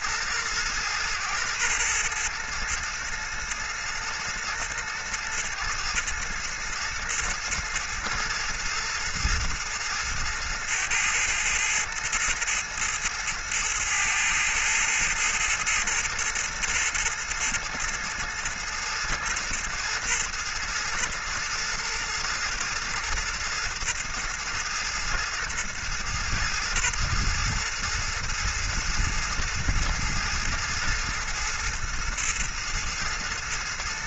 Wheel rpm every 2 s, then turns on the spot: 110, 110, 110, 110, 110, 110, 110, 110, 120, 110, 110, 110, 110, 110, 110, 110, 110.
none